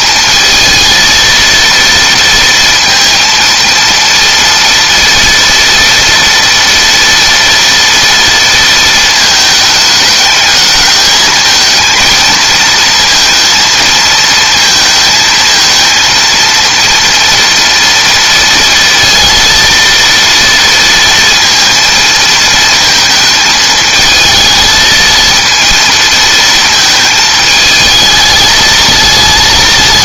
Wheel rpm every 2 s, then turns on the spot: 230, 230, 230, 230, 230, 220, 230, 230, 230, 230, 230, 220, 230, 220, 220.
none